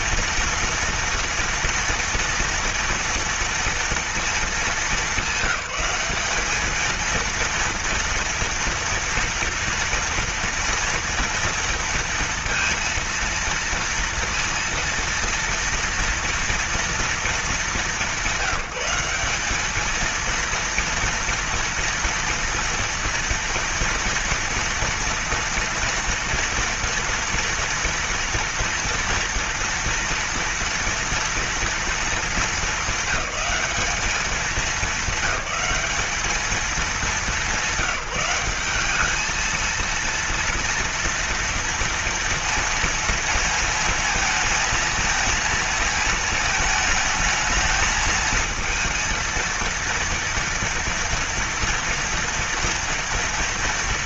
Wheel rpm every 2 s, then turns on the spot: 240, 230, 200, 220, 230, 230, 230, 230, 230, 190, 230, 230, 230, 230, 230, 230, 210, 200, 200, 210, 230, 230, 220, 220, 230, 230, 230.
none